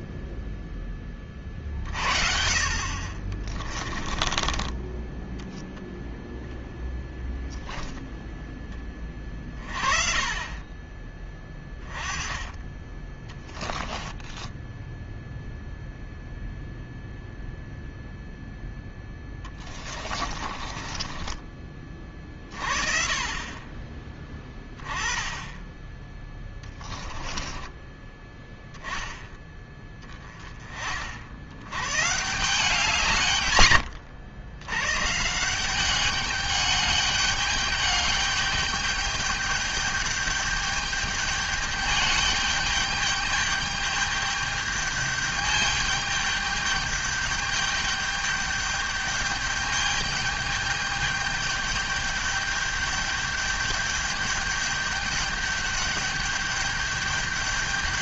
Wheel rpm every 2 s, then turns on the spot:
20, 40, 20, 0, 10, 20, 20, 10, 0, 10, 30, 30, 10, 20, 10, 30, 160, 110, 200, 210, 210, 210, 210, 210, 210, 210, 210, 210, 210.
14-16 20-22 26-28